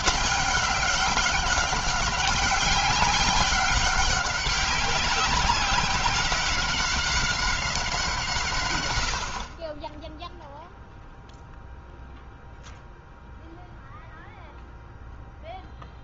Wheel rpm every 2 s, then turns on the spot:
200, 190, 190, 190, 110, 0, 0, 0.
none